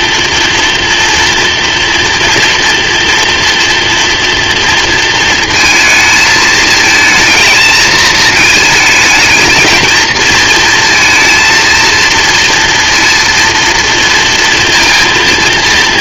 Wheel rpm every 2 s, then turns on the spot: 230, 230, 240, 220, 220, 230, 230, 230.
none